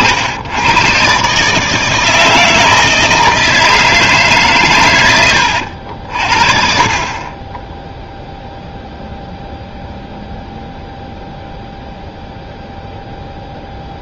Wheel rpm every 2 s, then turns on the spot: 100, 160, 140, 40, 0, 0, 0.
none